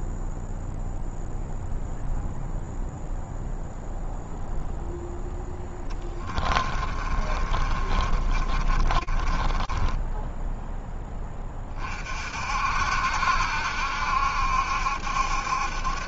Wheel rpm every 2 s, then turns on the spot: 0, 0, 0, 20, 40, 10, 60, 70.
6-10